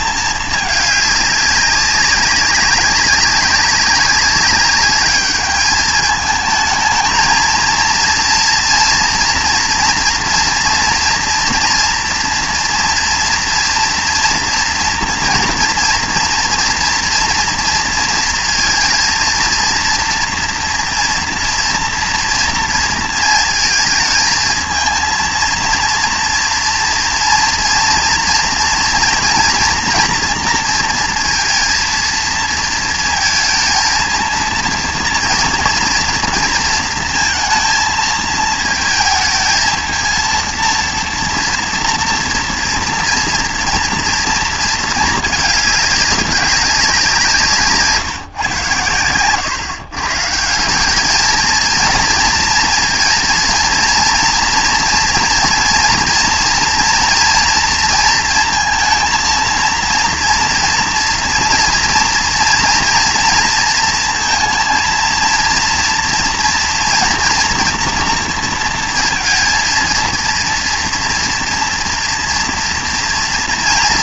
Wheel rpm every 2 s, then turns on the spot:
210, 190, 200, 220, 240, 230, 230, 230, 230, 230, 240, 230, 220, 230, 230, 230, 230, 230, 230, 220, 230, 230, 220, 200, 130, 170, 230, 240, 240, 230, 230, 240, 230, 230, 230, 230, 230.
none